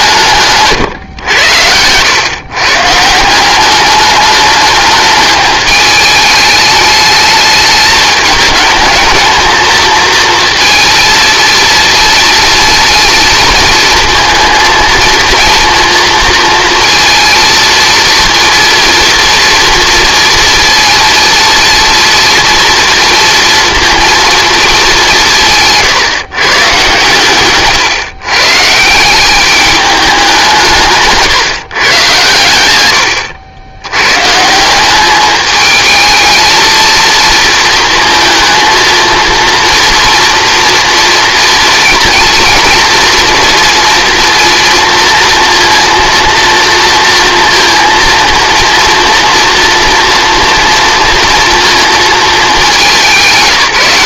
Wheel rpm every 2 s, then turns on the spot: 120, 140, 210, 210, 210, 230, 230, 230, 230, 230, 230, 230, 210, 140, 150, 160, 100, 180, 220, 230, 230, 230, 230, 230, 230, 230, 210.
none